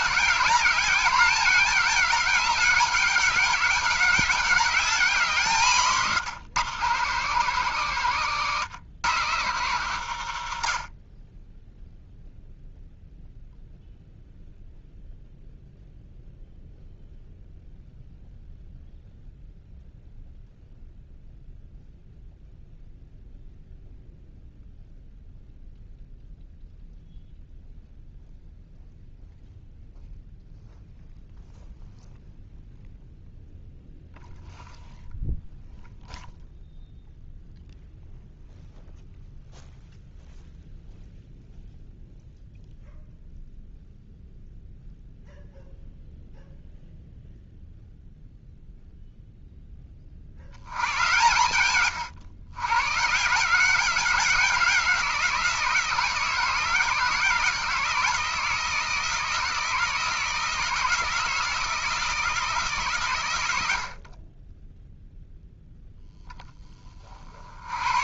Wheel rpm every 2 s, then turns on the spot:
200, 200, 200, 170, 160, 60, 0, 0, 0, 0, 0, 0, 0, 0, 0, 0, 0, 0, 0, 0, 0, 0, 0, 0, 0, 110, 130, 180, 160, 160, 160, 140, 0, 20.
none